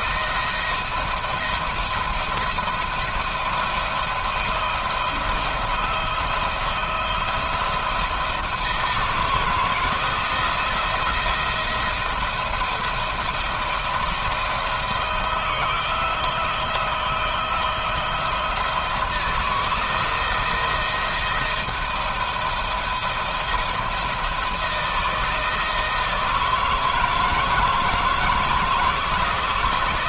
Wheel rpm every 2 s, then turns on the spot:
170, 170, 170, 170, 160, 170, 170, 160, 160, 160, 170, 170, 170, 160, 170.
none